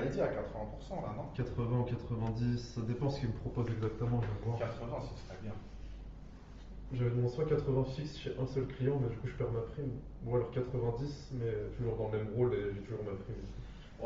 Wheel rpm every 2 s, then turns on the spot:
0, 0, 0, 0, 0, 0, 0.
none